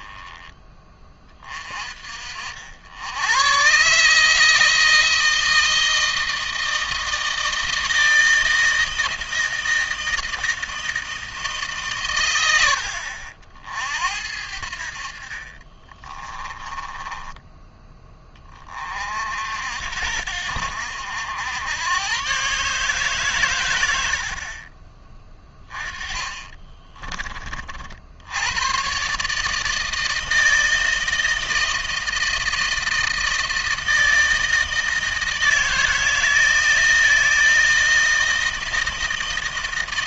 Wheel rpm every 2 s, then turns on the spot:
20, 60, 160, 160, 160, 160, 100, 70, 30, 30, 70, 140, 40, 20, 110, 160, 160, 160, 160, 160.
16-18 26-28